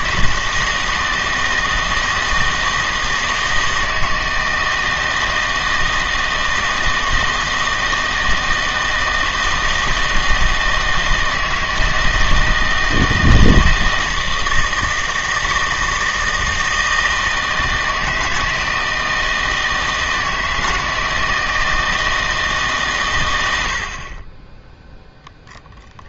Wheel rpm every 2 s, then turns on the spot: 160, 160, 160, 160, 160, 160, 160, 160, 160, 160, 160, 140, 10.
none